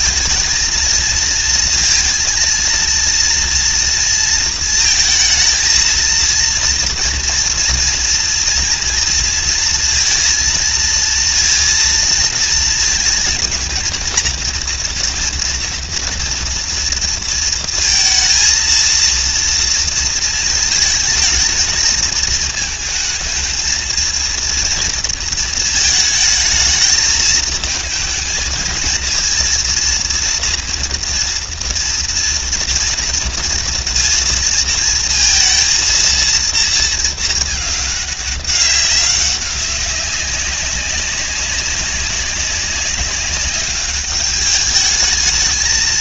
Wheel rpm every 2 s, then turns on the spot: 230, 230, 230, 230, 230, 230, 230, 230, 230, 220, 220, 220, 230, 220, 230, 230, 230, 230, 230, 200, 190, 200, 210.
none